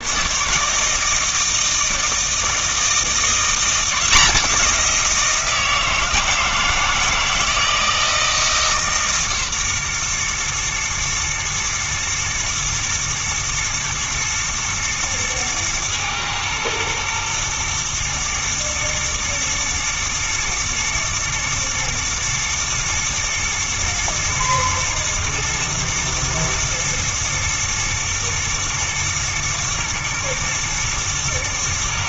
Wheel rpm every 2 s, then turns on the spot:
150, 170, 180, 160, 150, 120, 110, 110, 120, 120, 120, 120, 110, 110, 120, 120.
none